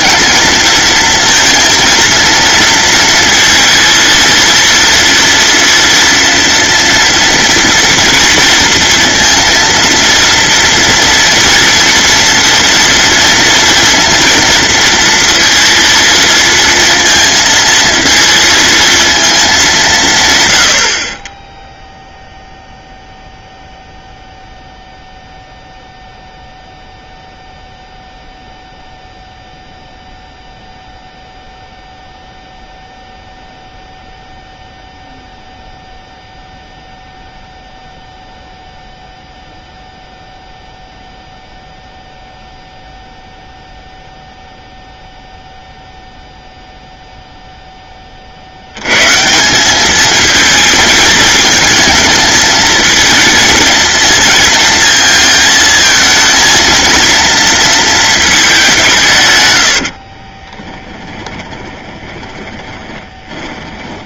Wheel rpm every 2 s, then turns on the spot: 220, 230, 230, 230, 230, 230, 230, 230, 230, 230, 40, 0, 0, 0, 0, 0, 0, 0, 0, 0, 0, 0, 0, 0, 100, 220, 220, 230, 230, 180, 20, 20.
60-64